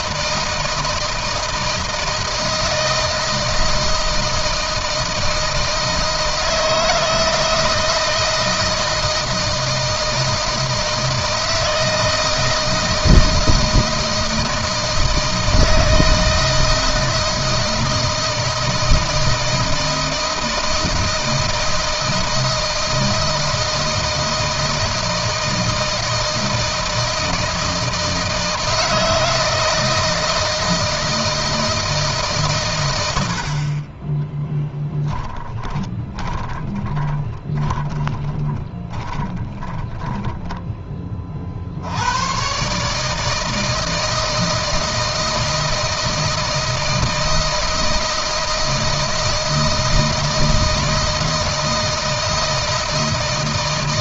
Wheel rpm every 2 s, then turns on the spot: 160, 160, 160, 160, 160, 160, 160, 160, 160, 160, 160, 170, 160, 160, 160, 160, 100, 10, 20, 20, 20, 140, 160, 160, 160, 160, 160.
34-40